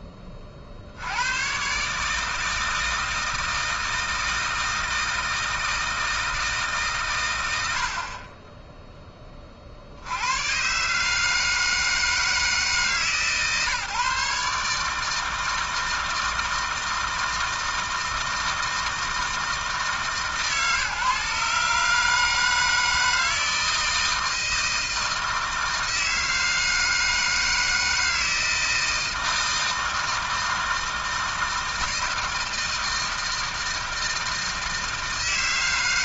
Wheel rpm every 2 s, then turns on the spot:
80, 160, 160, 140, 10, 140, 150, 160, 160, 160, 150, 160, 160, 160, 160, 160, 160, 150.
none